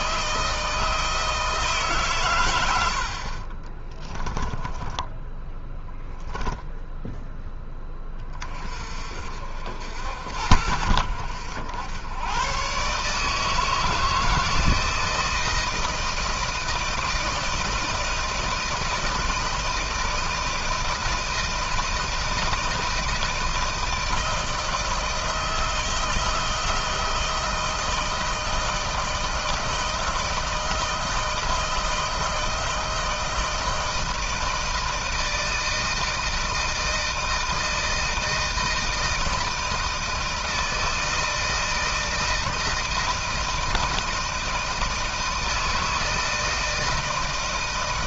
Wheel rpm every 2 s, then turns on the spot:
160, 120, 20, 0, 40, 70, 130, 160, 160, 160, 170, 160, 160, 160, 160, 160, 160, 160, 160, 160, 160, 160, 160, 160.
2-6